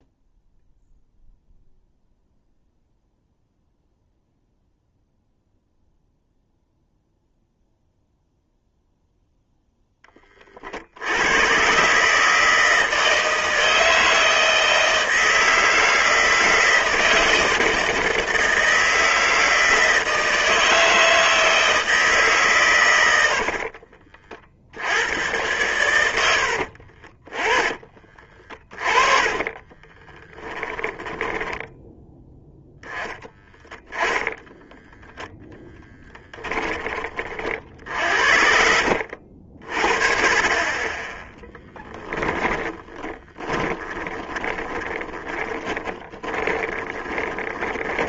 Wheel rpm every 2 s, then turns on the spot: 0, 0, 0, 0, 0, 60, 160, 160, 160, 160, 160, 120, 80, 40, 20, 10, 10, 10, 20, 70, 20, 20, 20, 30.
26-32 34-40 42-48